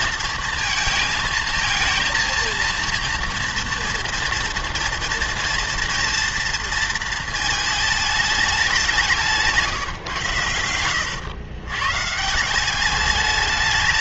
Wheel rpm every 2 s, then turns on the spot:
230, 230, 230, 230, 200, 110, 180.
none